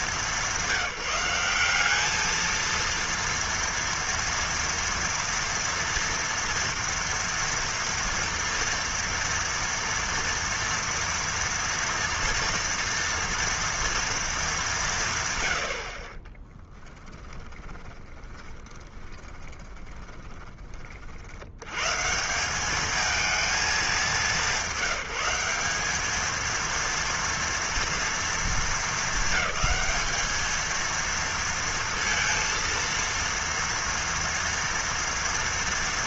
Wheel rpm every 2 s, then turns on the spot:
200, 220, 230, 230, 230, 230, 230, 220, 30, 10, 20, 170, 200, 220, 230, 220, 230, 230.
16-20